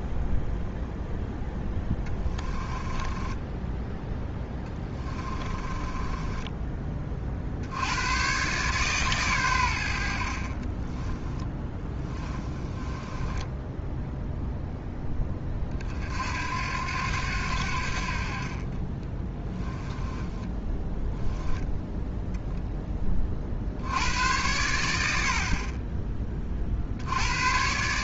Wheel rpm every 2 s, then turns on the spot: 0, 10, 20, 40, 130, 10, 10, 20, 80, 10, 10, 30, 60, 90.
2-6 10-14 18-20